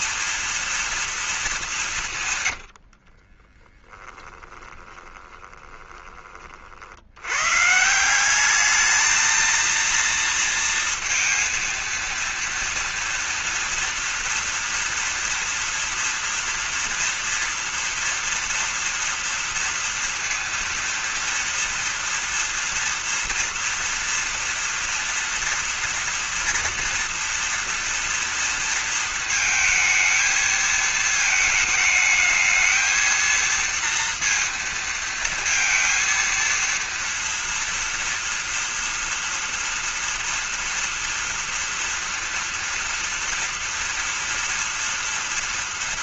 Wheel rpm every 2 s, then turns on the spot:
240, 100, 10, 40, 200, 230, 230, 230, 230, 230, 230, 230, 230, 240, 230, 220, 220, 230, 230, 240, 230, 230, 230.
2-6